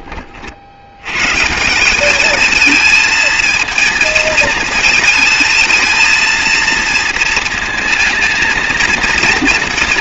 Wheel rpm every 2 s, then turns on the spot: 90, 220, 220, 230, 220.
none